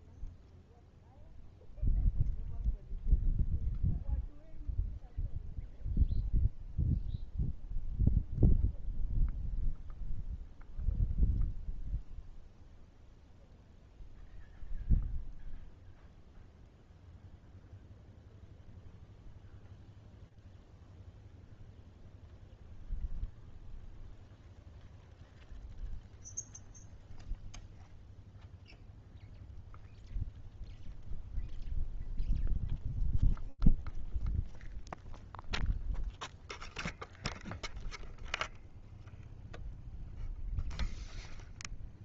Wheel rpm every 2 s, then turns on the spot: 0, 0, 0, 0, 0, 0, 0, 0, 0, 0, 0, 0, 0, 0, 0, 0, 0, 0, 0, 0, 0.
none